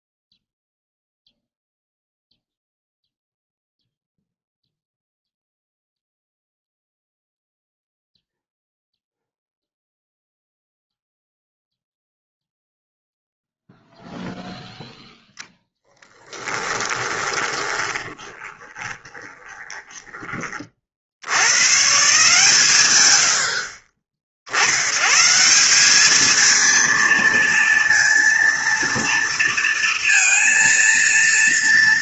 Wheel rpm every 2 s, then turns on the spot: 0, 0, 0, 0, 0, 0, 0, 0, 20, 20, 70, 110, 130, 230, 230, 230.
16-20